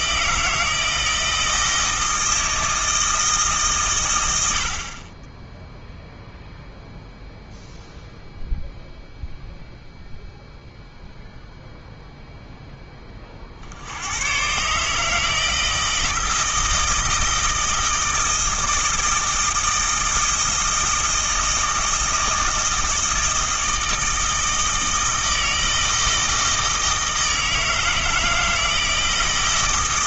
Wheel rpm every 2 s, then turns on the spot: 160, 160, 50, 0, 0, 0, 10, 140, 160, 160, 160, 160, 160, 160, 160.
none